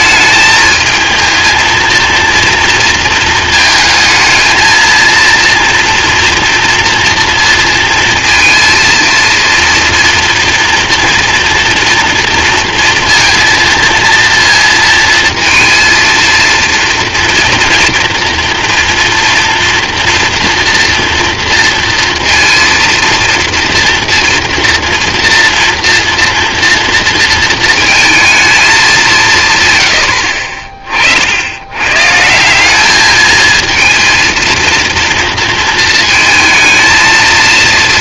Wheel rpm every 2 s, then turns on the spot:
220, 230, 220, 240, 230, 230, 230, 230, 230, 230, 230, 230, 230, 230, 220, 40, 180, 230, 220.
30-32